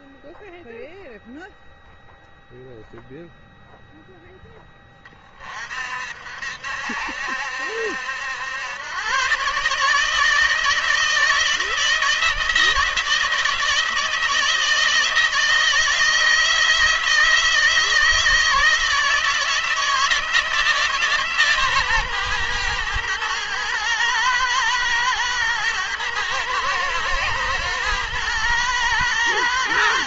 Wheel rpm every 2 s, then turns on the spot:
0, 0, 10, 60, 100, 160, 160, 160, 170, 160, 160, 120, 110, 110, 120.
none